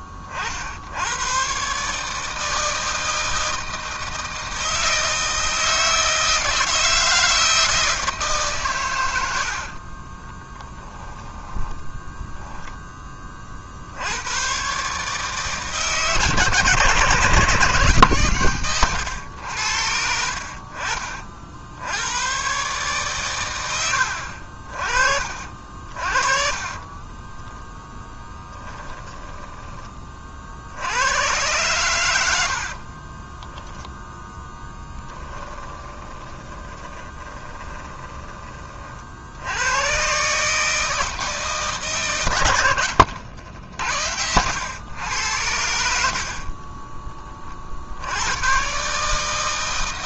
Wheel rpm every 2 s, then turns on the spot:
80, 160, 160, 160, 120, 10, 10, 130, 130, 110, 40, 130, 50, 30, 20, 80, 40, 10, 20, 30, 150, 90, 100, 10, 140.
10-12 26-30 32-38 42-44